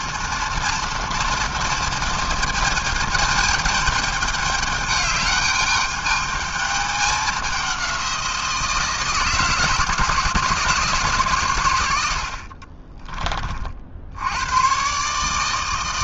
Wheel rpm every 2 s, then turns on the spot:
240, 220, 210, 210, 170, 160, 50, 110.
12-14